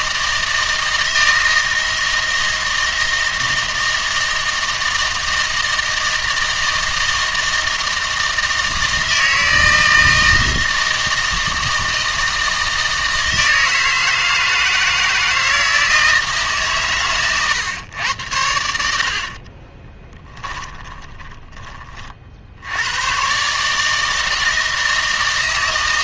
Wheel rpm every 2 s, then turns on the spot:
160, 160, 160, 160, 160, 160, 160, 160, 140, 70, 10, 90, 160.
20-22